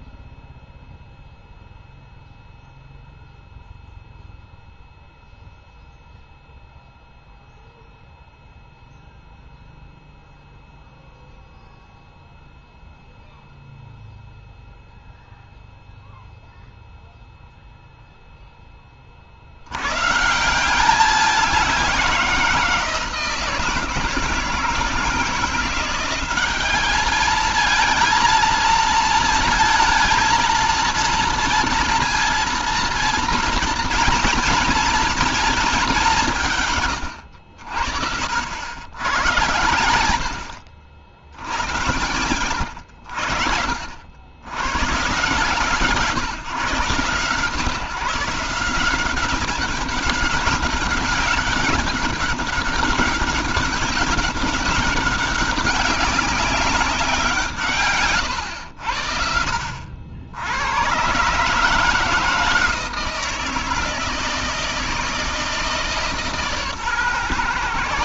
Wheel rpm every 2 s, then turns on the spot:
0, 0, 0, 0, 0, 0, 0, 0, 0, 10, 170, 170, 160, 200, 230, 230, 230, 230, 160, 70, 60, 110, 110, 130, 170, 200, 200, 200, 200, 100, 90, 160, 160, 140.
none